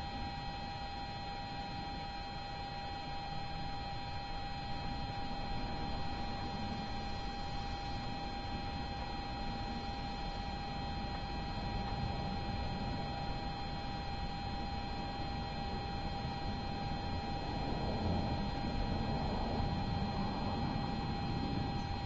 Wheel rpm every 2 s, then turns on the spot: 0, 0, 0, 0, 0, 0, 0, 0, 0, 0, 0.
none